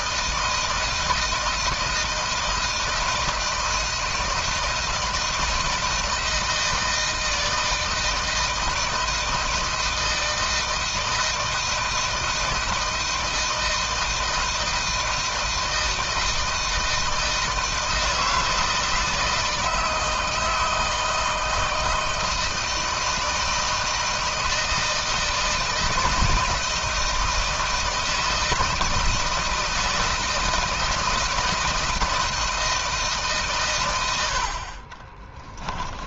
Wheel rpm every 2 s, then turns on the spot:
160, 160, 160, 160, 160, 160, 160, 160, 160, 160, 160, 160, 160, 160, 160, 160, 160, 40.
34-36